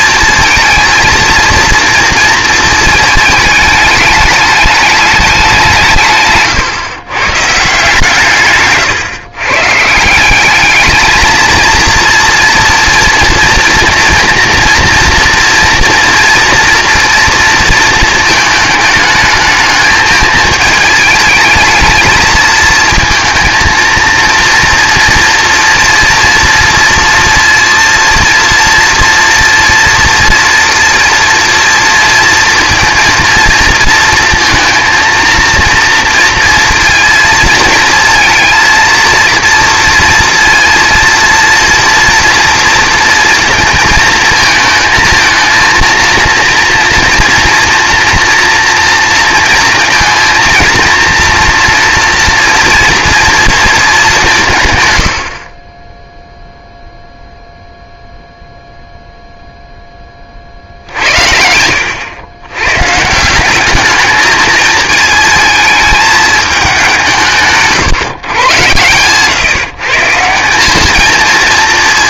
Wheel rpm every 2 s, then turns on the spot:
230, 220, 210, 120, 140, 200, 230, 230, 230, 210, 220, 220, 230, 230, 230, 230, 230, 230, 230, 230, 230, 230, 230, 230, 230, 230, 230, 150, 0, 0, 60, 130, 220, 200, 120, 200.
none